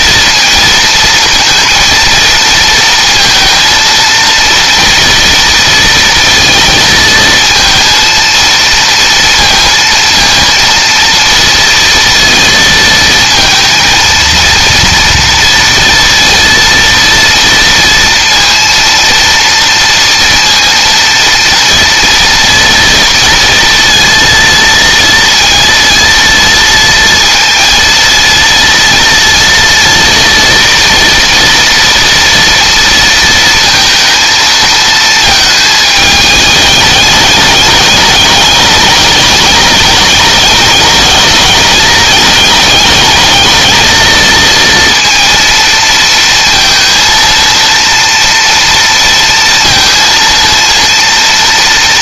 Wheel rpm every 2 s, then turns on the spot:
230, 230, 230, 230, 230, 230, 220, 230, 230, 230, 230, 230, 230, 230, 230, 230, 230, 220, 210, 210, 210, 210, 230, 230, 230, 230.
none